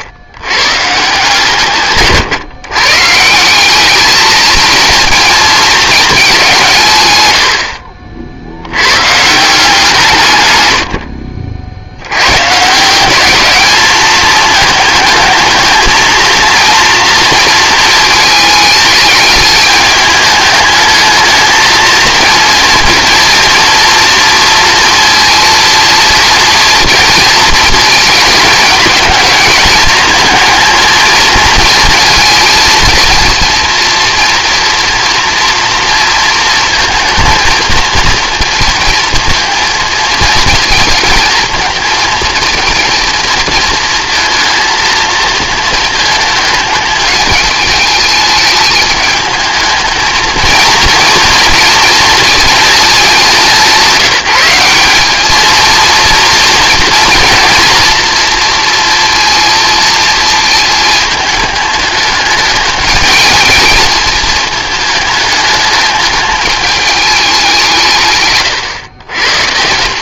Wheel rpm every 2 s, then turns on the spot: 140, 140, 230, 160, 90, 100, 160, 220, 230, 220, 220, 230, 230, 230, 210, 220, 230, 230, 220, 230, 230, 230, 220, 220, 210, 230, 220, 190, 230, 230, 220, 210, 220, 210, 130.
none